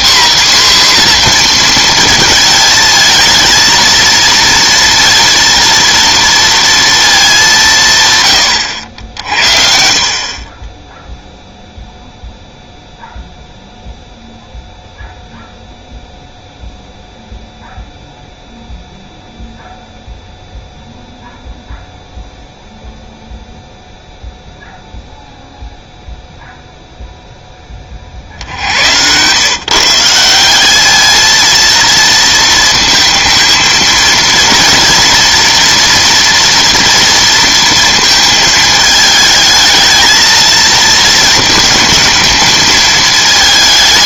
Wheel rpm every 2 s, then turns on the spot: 260, 220, 230, 230, 90, 20, 0, 0, 0, 0, 0, 0, 0, 0, 70, 200, 230, 230, 230, 220, 220, 220.
none